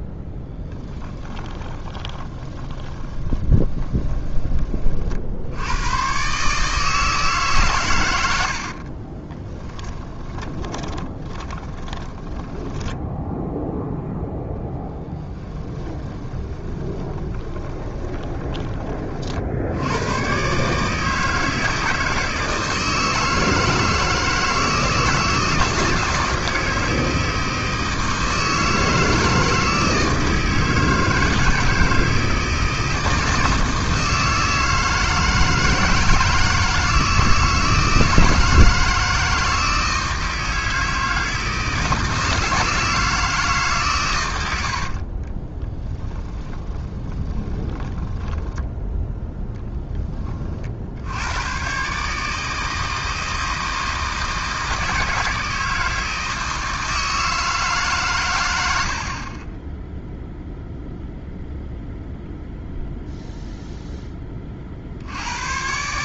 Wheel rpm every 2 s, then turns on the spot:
10, 20, 40, 150, 50, 20, 10, 10, 20, 20, 150, 160, 160, 160, 160, 160, 160, 160, 160, 160, 160, 160, 80, 20, 10, 50, 160, 160, 160, 80, 0, 0, 50.
0-4 8-18 44-50